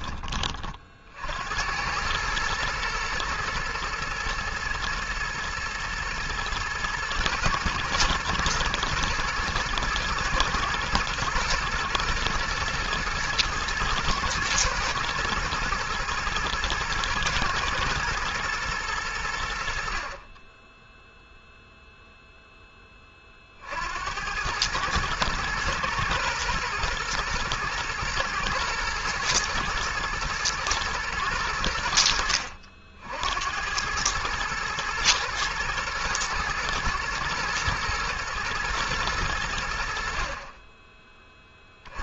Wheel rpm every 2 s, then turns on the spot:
40, 120, 120, 110, 120, 120, 120, 120, 120, 110, 10, 10, 100, 120, 110, 110, 60, 110, 110, 120, 30.
none